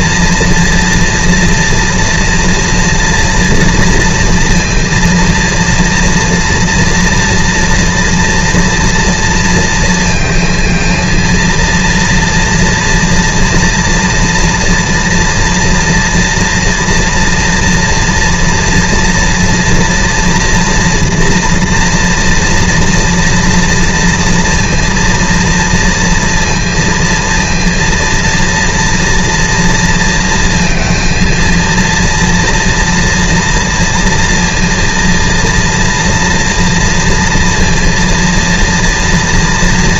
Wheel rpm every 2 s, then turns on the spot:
230, 230, 230, 240, 240, 230, 230, 230, 230, 230, 230, 230, 230, 230, 230, 230, 230, 230, 240, 230.
none